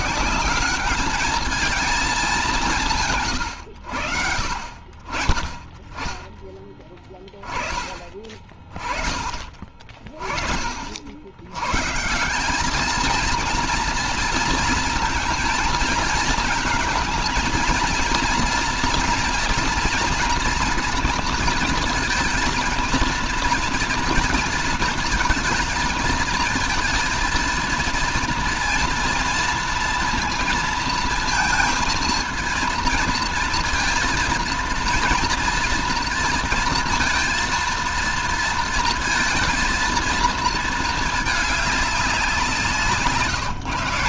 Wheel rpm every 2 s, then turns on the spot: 200, 170, 50, 20, 20, 60, 210, 220, 230, 230, 230, 230, 230, 230, 230, 230, 230, 230, 230, 230, 220, 160.
none